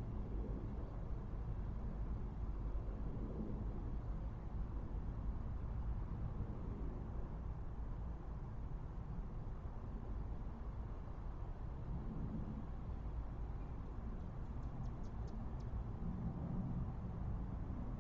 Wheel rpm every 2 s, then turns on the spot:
0, 0, 0, 0, 0, 0, 0, 0, 0.
none